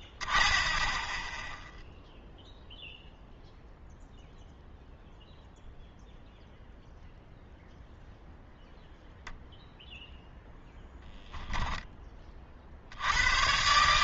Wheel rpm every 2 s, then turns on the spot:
0, 0, 0, 0, 0, 0, 40.
none